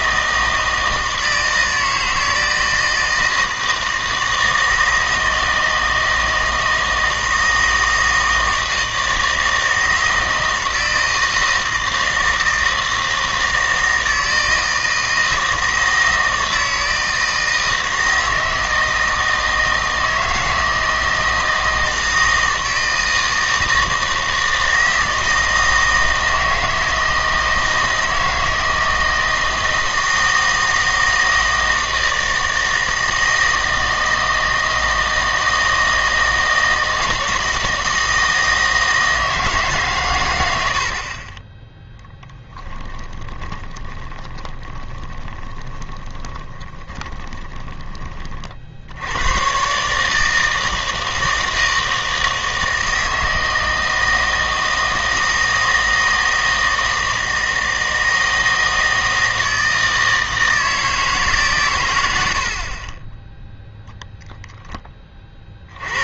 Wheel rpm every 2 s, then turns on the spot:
160, 160, 160, 160, 160, 160, 160, 160, 160, 160, 160, 160, 160, 160, 160, 160, 160, 160, 160, 160, 80, 10, 20, 20, 50, 160, 160, 160, 160, 160, 160, 60, 10.
42-48